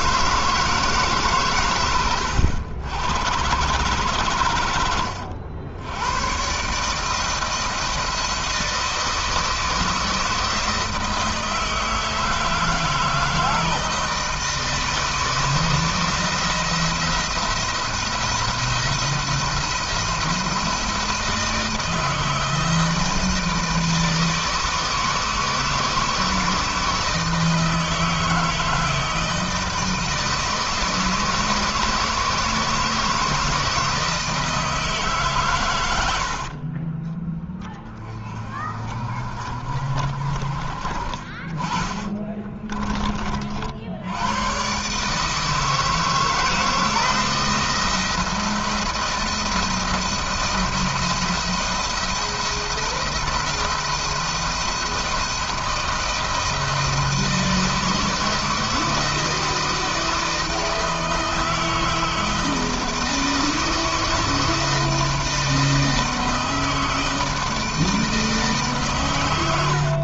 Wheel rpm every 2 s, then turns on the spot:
150, 100, 90, 160, 160, 160, 160, 160, 170, 170, 170, 160, 160, 160, 160, 160, 160, 150, 20, 40, 30, 30, 140, 160, 170, 170, 170, 170, 160, 160, 160, 160, 160, 160, 120.
40-42